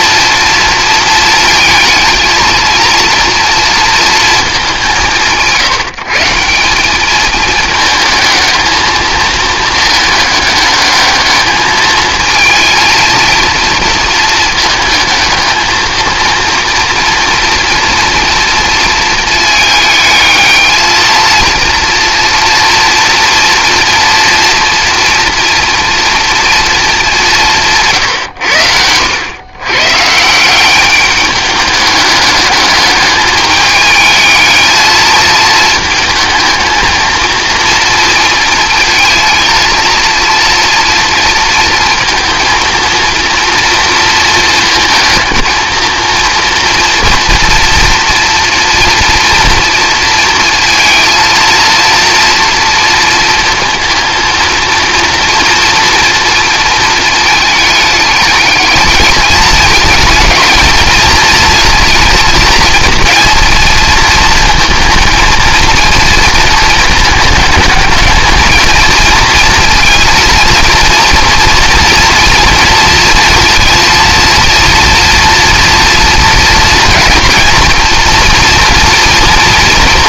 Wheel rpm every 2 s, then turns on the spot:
230, 230, 190, 190, 220, 210, 220, 220, 230, 230, 220, 230, 230, 220, 100, 190, 210, 220, 230, 230, 230, 230, 220, 230, 230, 230, 230, 230, 230, 210, 220, 230, 230, 220, 230, 230, 230, 230, 230, 230.
none